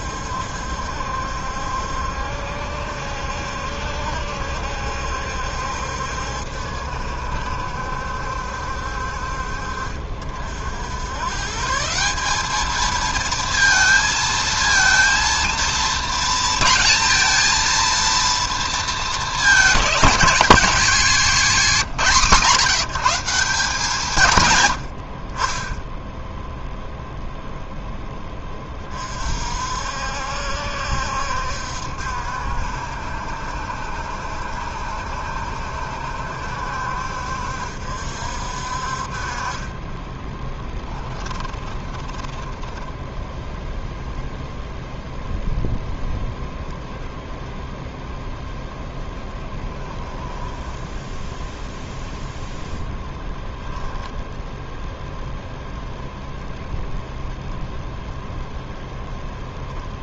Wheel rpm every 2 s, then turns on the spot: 70, 70, 70, 70, 60, 80, 220, 230, 230, 220, 220, 170, 80, 0, 20, 70, 60, 70, 70, 50, 10, 10, 0, 0, 0, 10, 0, 0, 0, 0.
40-44 50-52